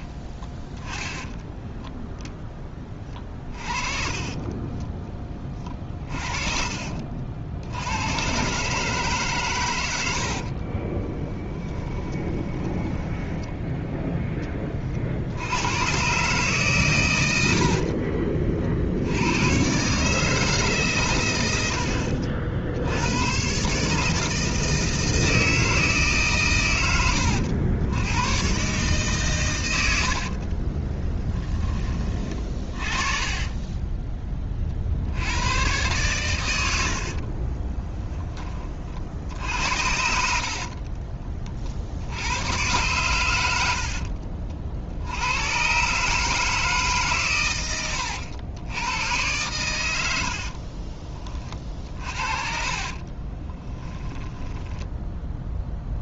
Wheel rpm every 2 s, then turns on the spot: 20, 30, 10, 50, 140, 20, 10, 40, 120, 50, 130, 80, 160, 100, 130, 20, 30, 50, 70, 40, 40, 110, 60, 150, 100, 30, 30, 10.
2-4 10-14 30-34 36-38 40-42 50-56